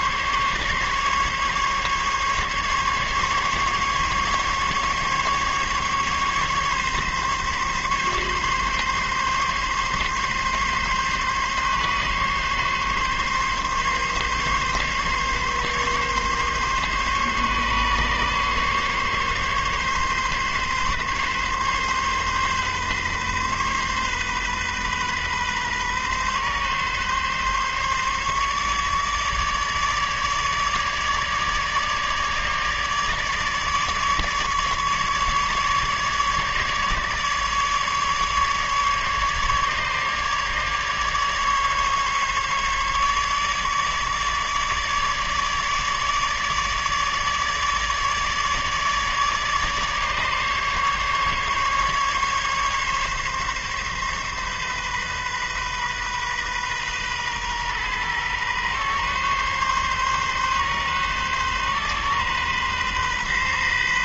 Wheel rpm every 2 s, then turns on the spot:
140, 140, 140, 140, 140, 140, 140, 140, 140, 140, 140, 140, 130, 140, 150, 150, 150, 150, 150, 150, 150, 150, 150, 150, 150, 150, 140, 130, 130, 130, 140, 130.
none